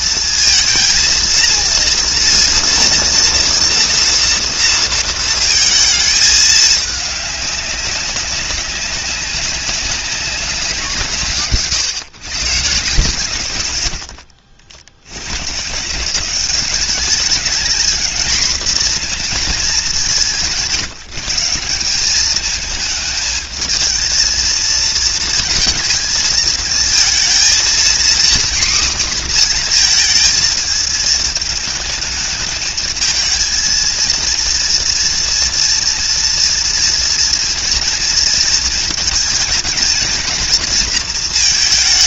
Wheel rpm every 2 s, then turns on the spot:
230, 230, 230, 220, 190, 190, 140, 60, 190, 240, 180, 210, 230, 220, 250, 220, 220, 230, 230, 230, 230.
none